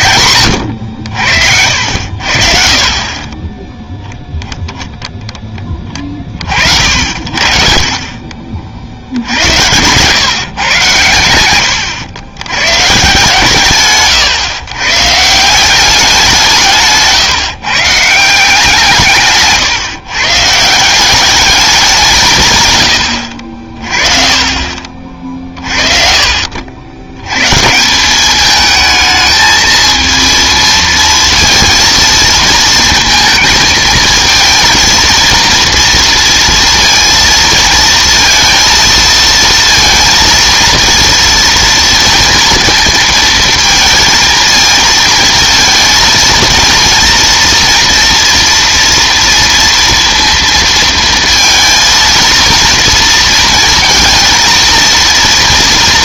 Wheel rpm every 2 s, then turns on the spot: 120, 60, 0, 60, 50, 120, 120, 140, 160, 170, 160, 130, 40, 60, 210, 230, 230, 230, 230, 230, 230, 230, 220, 230, 230, 230, 230, 230.
none